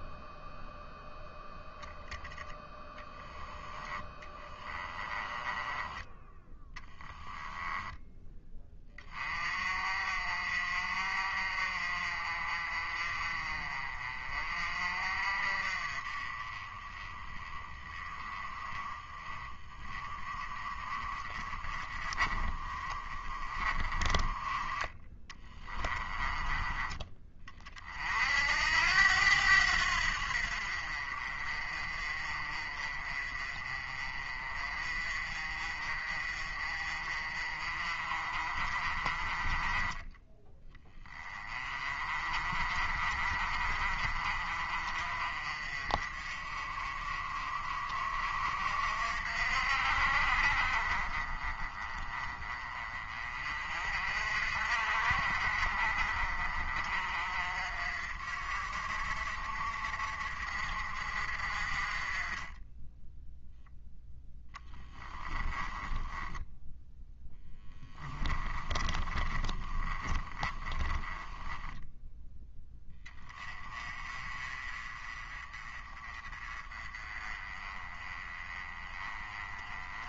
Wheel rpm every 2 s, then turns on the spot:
0, 20, 20, 10, 20, 50, 40, 40, 20, 30, 30, 30, 20, 20, 80, 50, 30, 40, 40, 50, 20, 40, 40, 40, 50, 40, 30, 50, 40, 50, 50, 10, 20, 10, 20, 20, 10, 30, 20, 20.
4-8 64-66 68-72